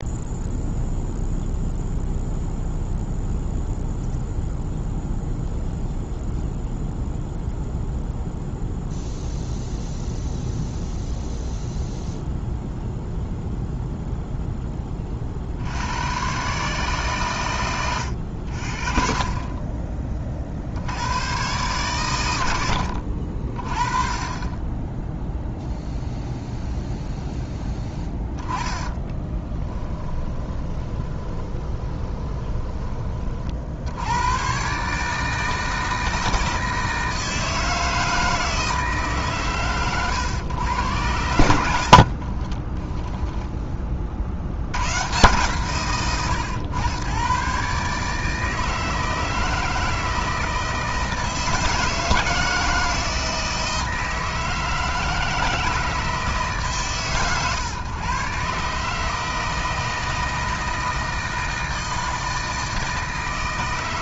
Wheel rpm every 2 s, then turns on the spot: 0, 0, 0, 0, 0, 0, 0, 0, 140, 70, 50, 100, 20, 0, 10, 30, 20, 130, 160, 160, 110, 30, 80, 100, 160, 160, 160, 160, 150, 140, 160, 160.
30-34 42-44